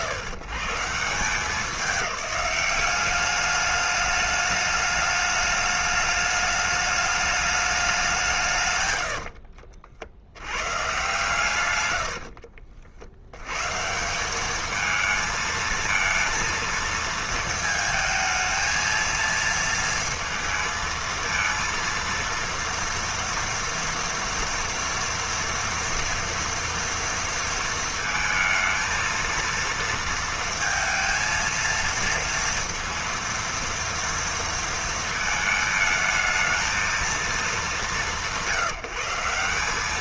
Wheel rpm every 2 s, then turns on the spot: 140, 200, 210, 210, 130, 110, 40, 210, 230, 230, 230, 230, 230, 230, 230, 230, 230, 230, 220, 180.
none